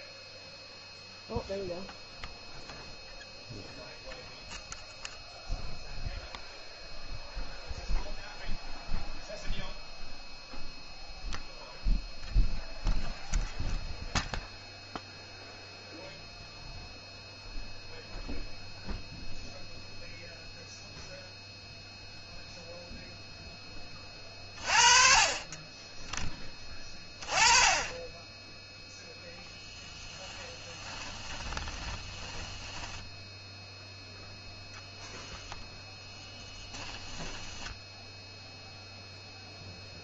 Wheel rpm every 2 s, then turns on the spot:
0, 0, 0, 0, 0, 0, 0, 0, 0, 0, 0, 0, 40, 20, 0, 10, 10, 0, 10, 0.
30-34 36-38